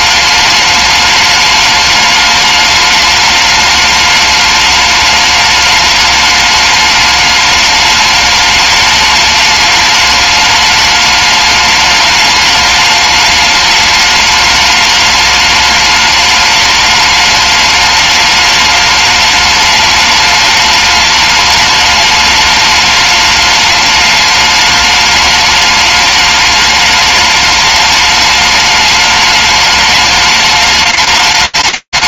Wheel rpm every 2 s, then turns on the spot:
210, 210, 210, 210, 210, 210, 210, 210, 210, 210, 210, 210, 210, 210, 210, 210.
none